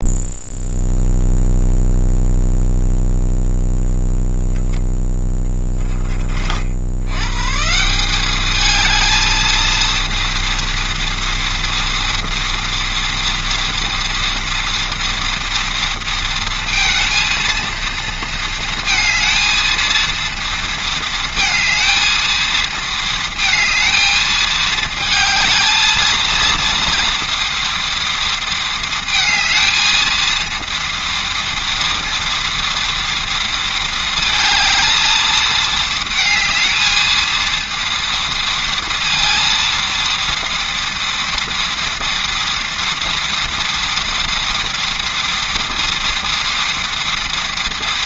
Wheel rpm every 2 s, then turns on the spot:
0, 0, 0, 90, 220, 230, 230, 230, 230, 230, 220, 220, 220, 230, 230, 230, 230, 220, 220, 230, 230, 230, 230, 230.
none